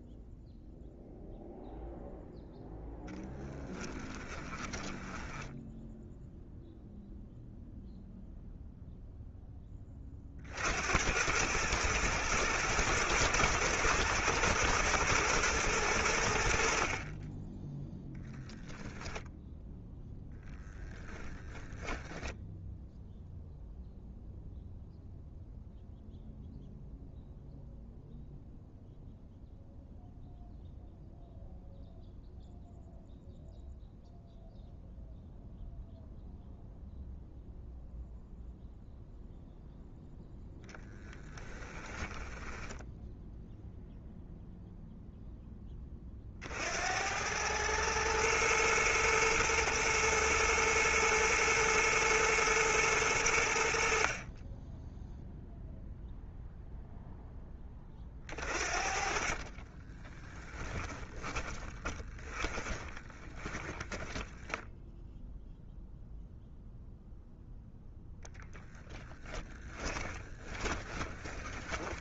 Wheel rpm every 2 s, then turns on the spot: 0, 0, 10, 0, 0, 80, 120, 120, 50, 0, 20, 0, 0, 0, 0, 0, 0, 0, 0, 0, 10, 10, 0, 80, 120, 120, 110, 10, 0, 50, 10, 20, 0, 0, 30, 20.
4-6 42-44 58-64 68-72